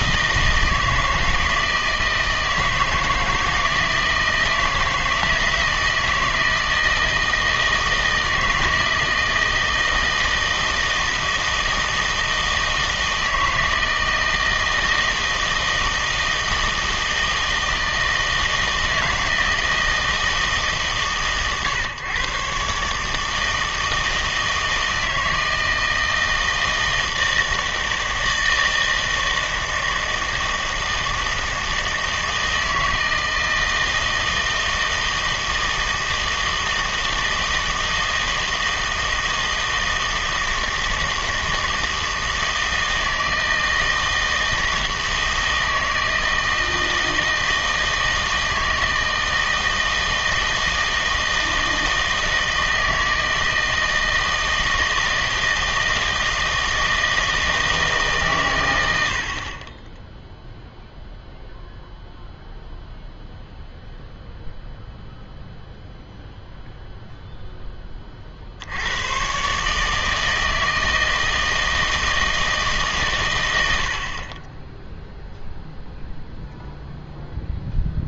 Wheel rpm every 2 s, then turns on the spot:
160, 160, 160, 160, 160, 160, 160, 160, 160, 160, 150, 130, 160, 160, 160, 160, 160, 160, 160, 160, 160, 160, 160, 160, 160, 160, 160, 160, 160, 100, 0, 0, 0, 0, 80, 160, 150, 10, 0.
none